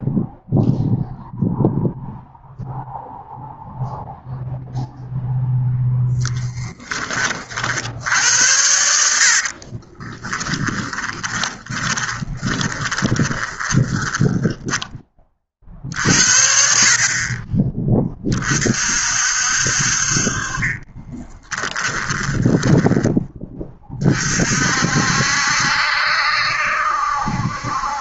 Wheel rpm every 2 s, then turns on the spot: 0, 0, 0, 20, 70, 10, 20, 20, 30, 50, 20, 20, 60, 70.
10-14 20-22